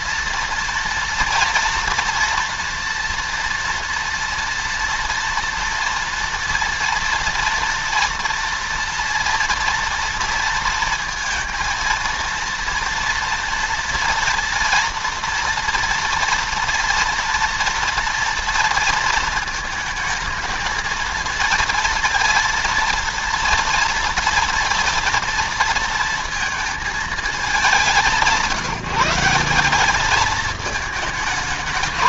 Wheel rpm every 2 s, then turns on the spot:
230, 230, 240, 230, 240, 230, 230, 230, 230, 230, 220, 230, 230, 220, 180, 220.
none